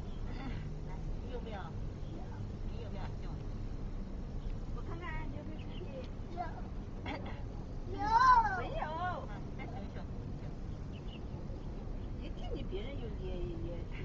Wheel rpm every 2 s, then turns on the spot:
0, 0, 0, 0, 0, 0, 0.
none